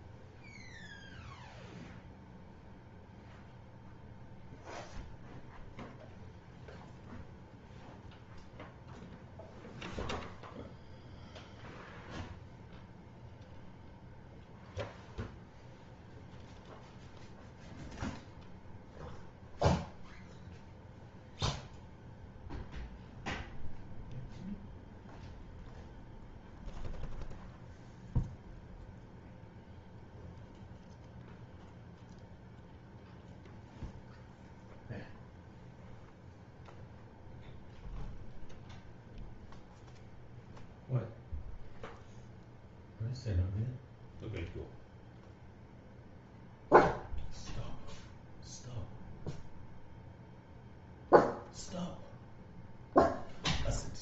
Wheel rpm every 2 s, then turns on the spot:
0, 0, 0, 0, 0, 0, 0, 0, 0, 0, 0, 0, 0, 0, 0, 0, 0, 0, 0, 0, 0, 0, 0, 0, 0, 0, 0.
none